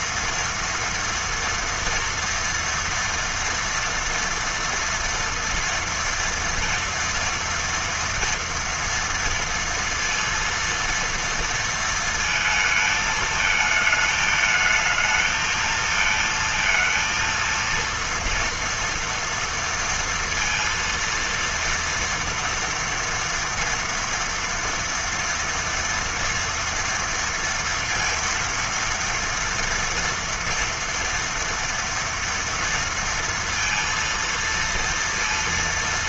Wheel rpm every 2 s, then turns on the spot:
230, 230, 230, 230, 230, 230, 230, 220, 230, 230, 230, 230, 230, 230, 230, 230, 230, 230.
none